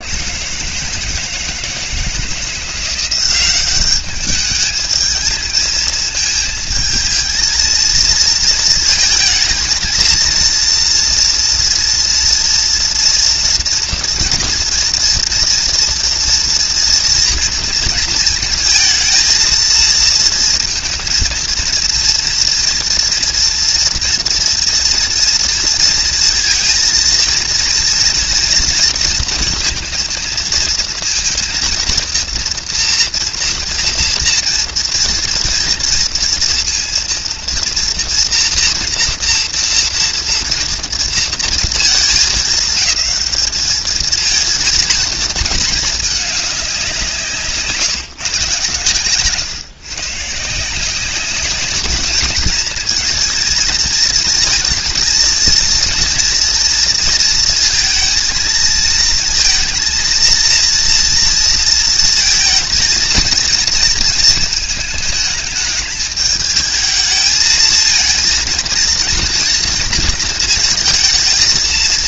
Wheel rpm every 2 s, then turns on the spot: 160, 170, 210, 220, 230, 230, 230, 230, 230, 220, 230, 240, 230, 230, 230, 230, 230, 230, 230, 230, 230, 210, 220, 200, 130, 160, 220, 230, 230, 220, 230, 220, 220, 220, 230, 230.
none